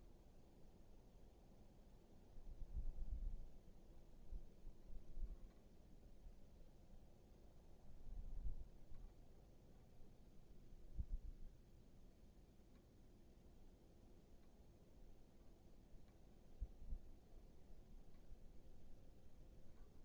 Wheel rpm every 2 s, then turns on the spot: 0, 0, 0, 0, 0, 0, 0, 0, 0, 0.
none